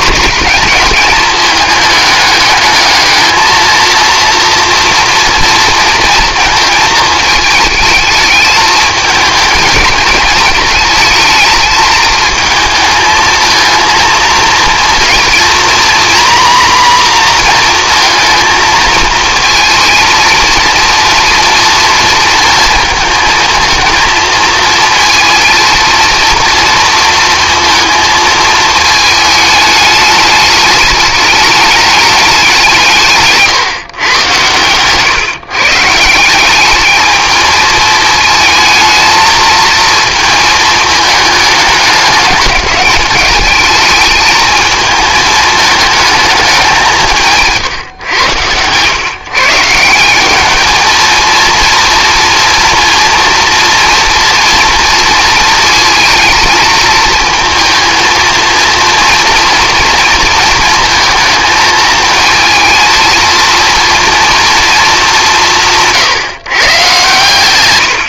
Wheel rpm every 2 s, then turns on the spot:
220, 220, 230, 220, 220, 220, 220, 240, 250, 230, 230, 230, 230, 230, 220, 210, 170, 120, 220, 220, 220, 210, 220, 190, 120, 220, 230, 230, 230, 230, 220, 230, 210, 130.
none